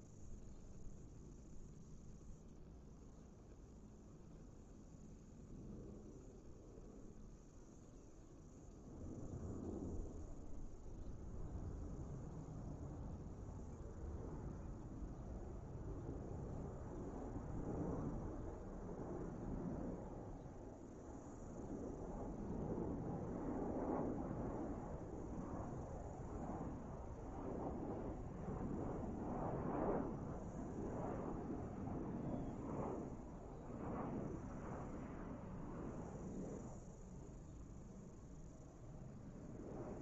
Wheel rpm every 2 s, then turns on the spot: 0, 0, 0, 0, 0, 0, 0, 0, 0, 0, 0, 0, 0, 0, 0, 0, 0, 0, 0, 0.
none